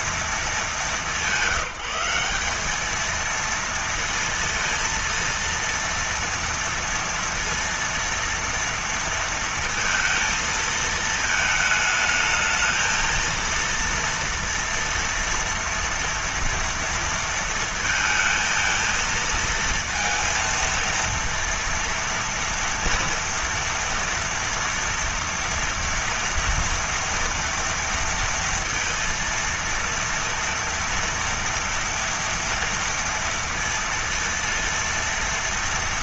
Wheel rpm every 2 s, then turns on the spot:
200, 220, 230, 230, 230, 220, 230, 230, 230, 230, 230, 240, 230, 230, 230, 230, 230, 230.
none